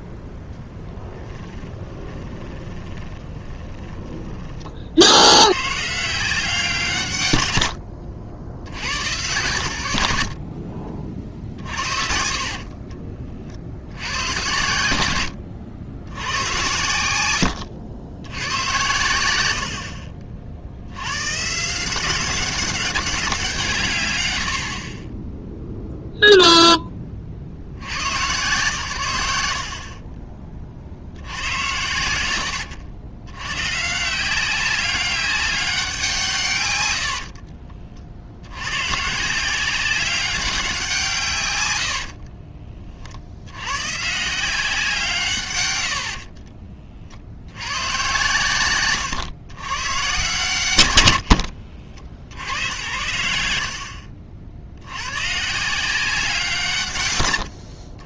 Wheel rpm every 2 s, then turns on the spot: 0, 20, 40, 170, 80, 50, 40, 90, 100, 90, 80, 190, 70, 0, 120, 40, 90, 190, 110, 110, 190, 40, 170, 40, 110, 110, 80, 80, 150.
2-4 10-14 46-48